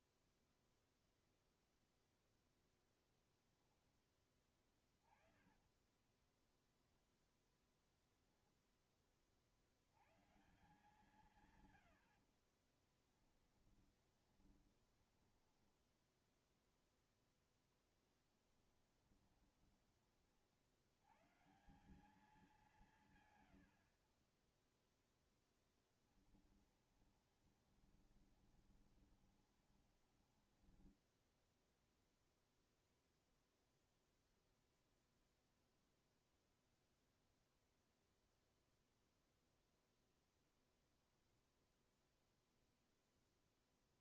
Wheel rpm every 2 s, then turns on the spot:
0, 10, 20, 10, 10, 140, 50, 20, 0, 20, 60, 180, 20, 20, 20, 10, 0, 0, 0, 0, 0, 0.
4-6 12-16 18-20 26-32